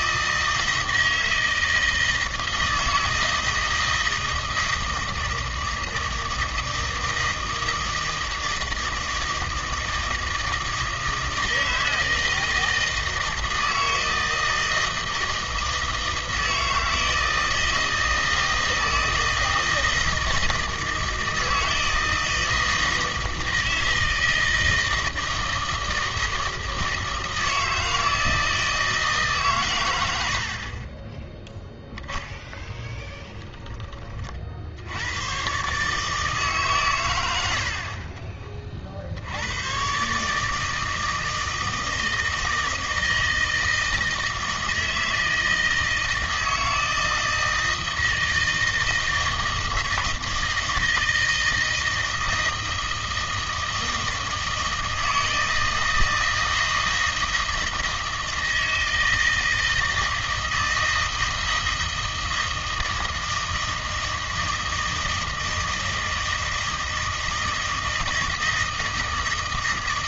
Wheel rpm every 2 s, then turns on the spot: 160, 160, 160, 160, 160, 160, 160, 160, 160, 160, 160, 160, 160, 160, 160, 50, 10, 70, 140, 30, 150, 160, 160, 160, 160, 160, 160, 160, 160, 160, 160, 160, 160, 160, 160.
none